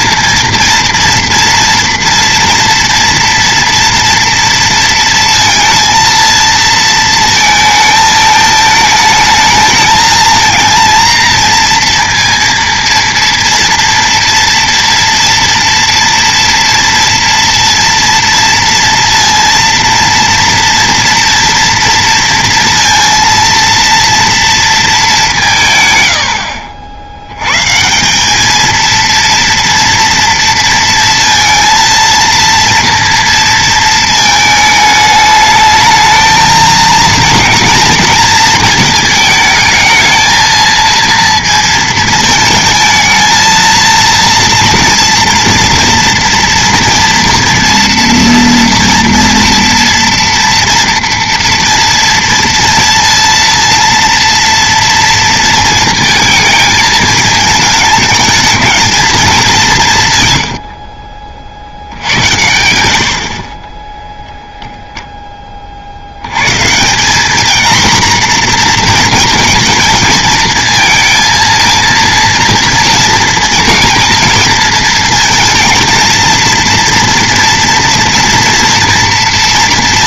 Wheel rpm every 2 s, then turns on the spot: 230, 230, 230, 230, 220, 230, 230, 230, 230, 230, 230, 230, 230, 70, 220, 230, 230, 220, 230, 230, 230, 220, 230, 230, 230, 230, 230, 230, 220, 220, 70, 80, 0, 140, 230, 220, 230, 230, 230, 230.
60-62